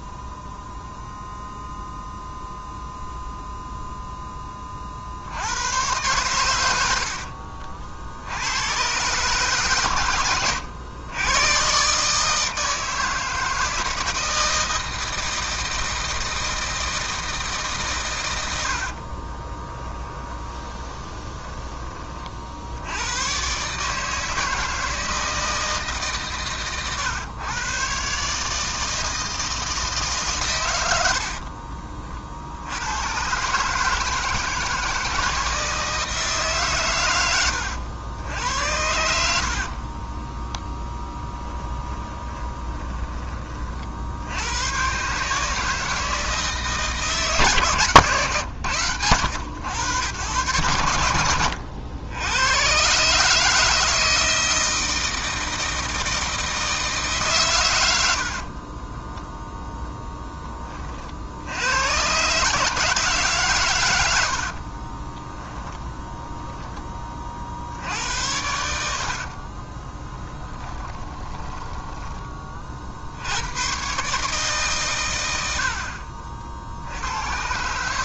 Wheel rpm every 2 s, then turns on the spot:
0, 0, 50, 70, 120, 100, 160, 160, 160, 50, 20, 100, 160, 120, 160, 80, 100, 160, 110, 80, 10, 20, 130, 150, 100, 90, 140, 160, 150, 20, 40, 160, 30, 20, 70, 20, 60, 120, 90.
18-22 40-44 58-60 64-66 68-72